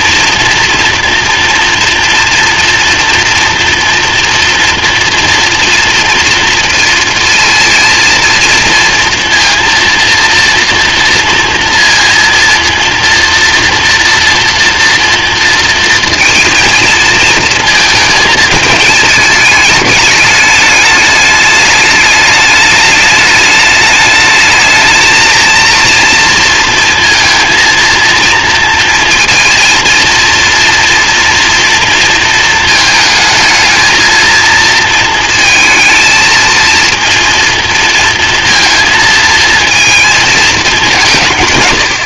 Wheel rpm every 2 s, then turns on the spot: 230, 240, 230, 230, 230, 230, 230, 230, 230, 220, 210, 210, 220, 230, 230, 230, 220, 230, 230, 230, 210.
none